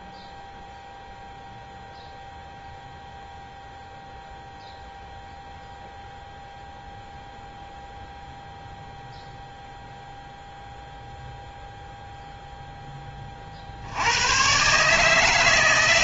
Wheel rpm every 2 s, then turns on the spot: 0, 0, 0, 0, 0, 0, 0, 130.
none